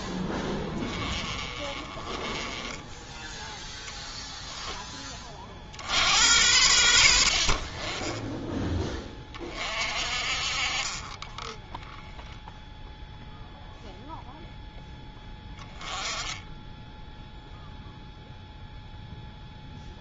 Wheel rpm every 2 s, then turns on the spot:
20, 10, 20, 90, 20, 40, 10, 10, 10, 0.
0-4 10-12